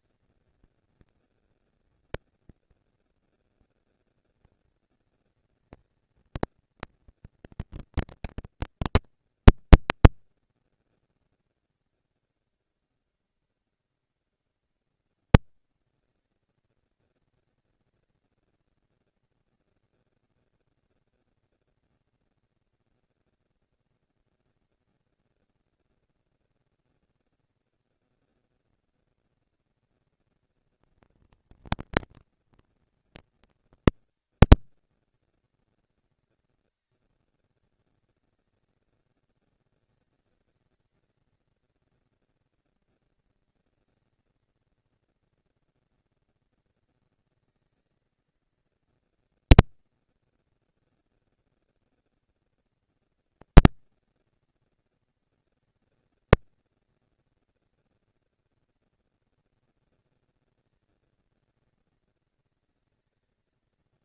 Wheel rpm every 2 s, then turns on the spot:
220, 230, 230, 230, 230, 230, 230, 230, 220, 230, 240, 230, 230, 230, 230, 230, 230, 200, 190, 190, 210, 230, 230, 230, 230, 240, 230, 230, 230, 240, 230, 220.
none